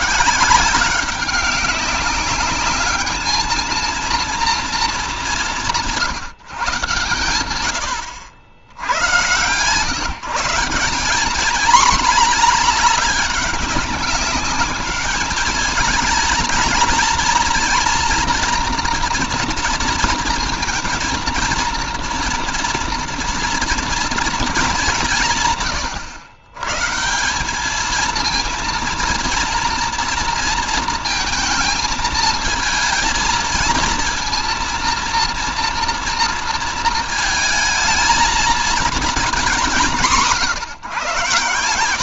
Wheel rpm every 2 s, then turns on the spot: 160, 200, 230, 140, 100, 160, 220, 210, 220, 230, 230, 230, 220, 120, 230, 230, 220, 230, 230, 230, 160.
none